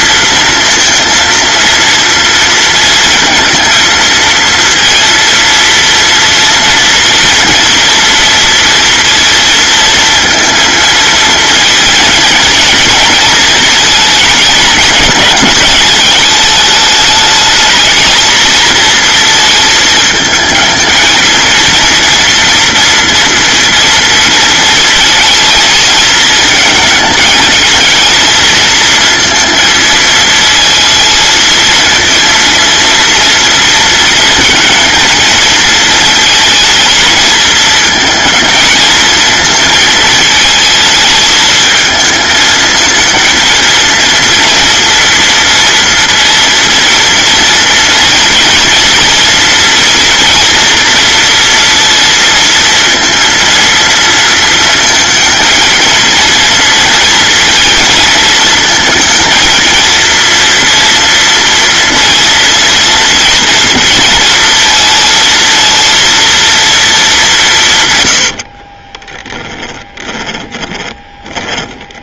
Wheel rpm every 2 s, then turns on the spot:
230, 230, 230, 240, 230, 230, 230, 220, 210, 230, 220, 230, 230, 220, 230, 220, 230, 230, 220, 230, 220, 220, 230, 230, 230, 230, 230, 230, 230, 230, 230, 230, 230, 220, 30, 20.
68-72